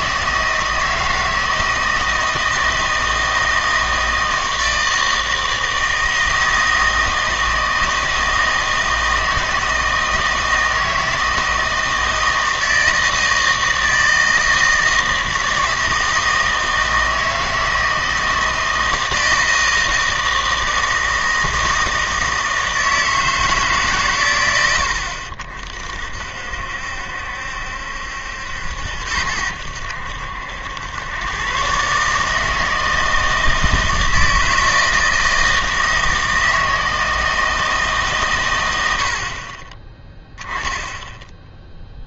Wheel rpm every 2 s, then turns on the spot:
160, 160, 160, 160, 160, 160, 160, 160, 160, 160, 160, 160, 90, 70, 80, 90, 160, 160, 160, 100, 10.
none